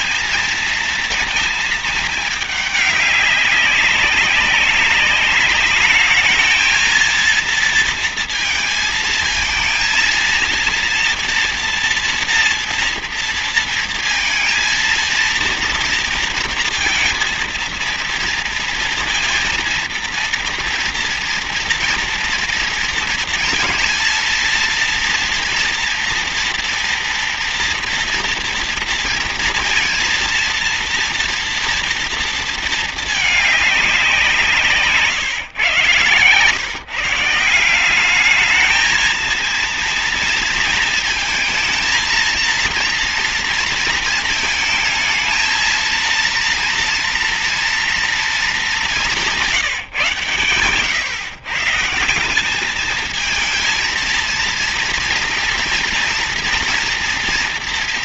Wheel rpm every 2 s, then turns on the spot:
230, 210, 200, 220, 230, 230, 230, 230, 230, 230, 230, 230, 230, 230, 230, 230, 230, 170, 140, 210, 230, 230, 220, 230, 210, 130, 190, 230, 230.
none